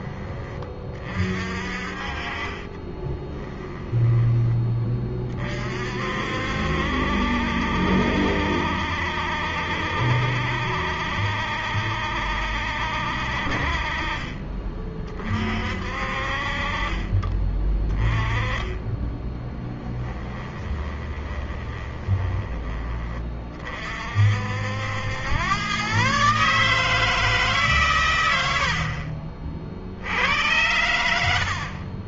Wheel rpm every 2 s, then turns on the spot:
30, 30, 20, 60, 70, 70, 60, 30, 40, 20, 20, 20, 70, 150, 80, 90.
2-4 20-22